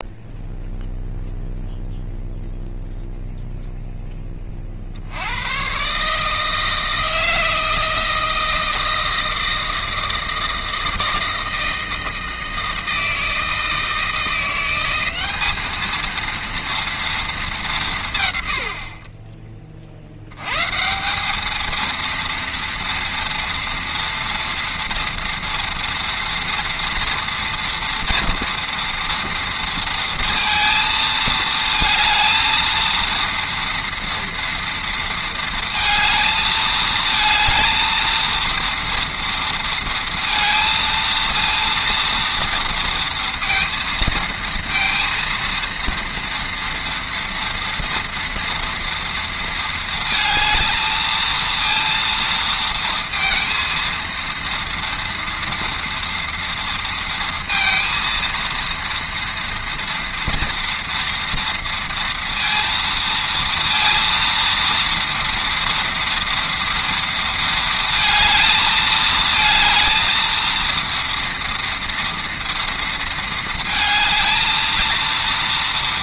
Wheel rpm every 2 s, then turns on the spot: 0, 0, 20, 160, 160, 160, 160, 170, 230, 120, 110, 230, 240, 230, 230, 230, 230, 230, 220, 230, 230, 230, 230, 230, 230, 220, 230, 230, 230, 230, 230, 230, 230, 230, 220, 230, 230, 230.
none